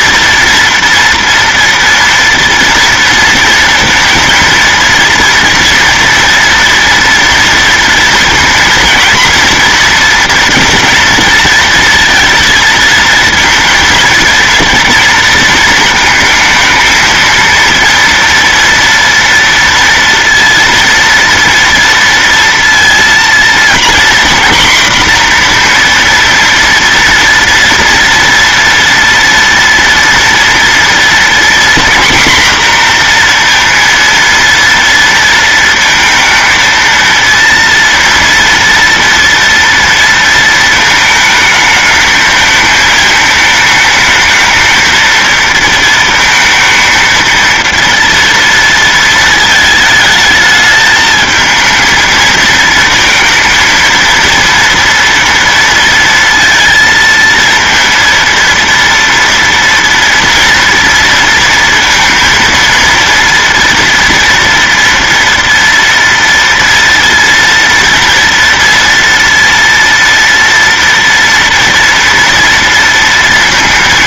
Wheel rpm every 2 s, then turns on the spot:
230, 230, 230, 230, 230, 230, 230, 230, 230, 240, 230, 230, 250, 230, 230, 230, 240, 230, 230, 230, 220, 220, 220, 230, 230, 220, 230, 230, 230, 230, 230, 230, 240, 230, 230, 230, 230.
none